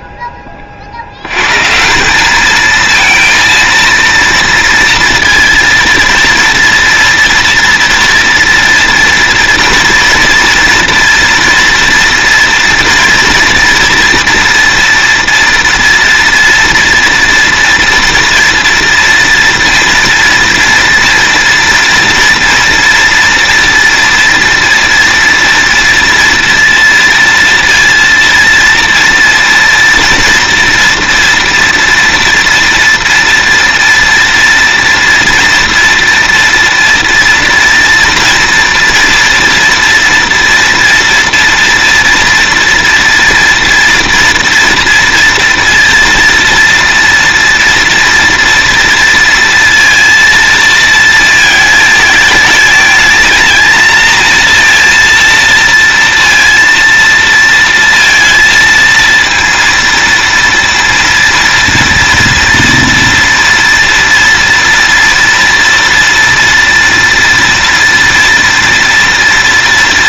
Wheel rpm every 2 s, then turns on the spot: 10, 200, 230, 230, 230, 230, 230, 230, 240, 230, 230, 230, 230, 230, 230, 240, 230, 230, 230, 230, 230, 230, 230, 230, 230, 230, 220, 230, 230, 230, 230, 230, 230, 230, 230.
none